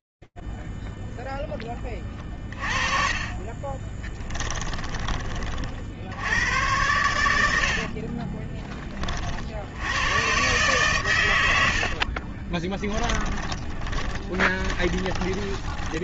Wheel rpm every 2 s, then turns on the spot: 10, 20, 40, 70, 70, 90, 20, 20.
2-4 6-8 10-16